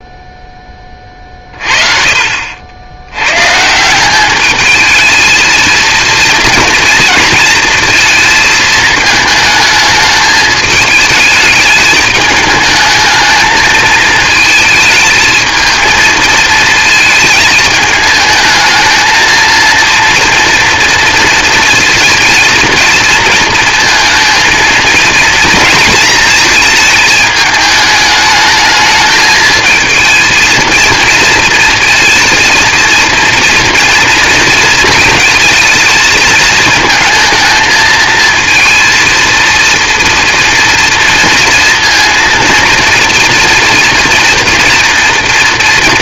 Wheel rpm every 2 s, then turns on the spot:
20, 70, 220, 230, 220, 220, 220, 220, 220, 220, 230, 220, 230, 220, 210, 230, 230, 230, 220, 230, 230, 230, 230.
none